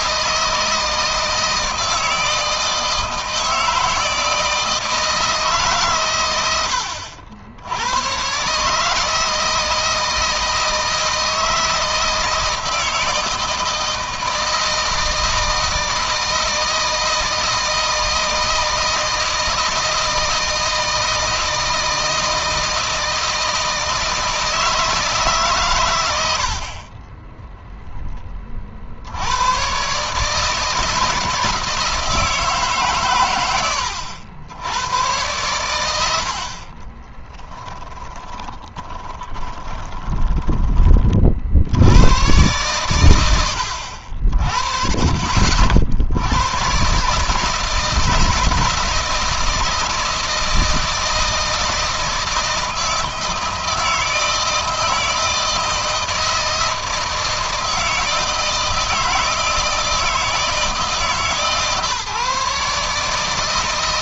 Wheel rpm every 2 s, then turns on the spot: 160, 160, 160, 80, 150, 160, 160, 160, 160, 160, 160, 160, 160, 40, 50, 160, 140, 100, 40, 20, 30, 100, 40, 130, 160, 160, 160, 160, 160, 160, 160, 150.
36-40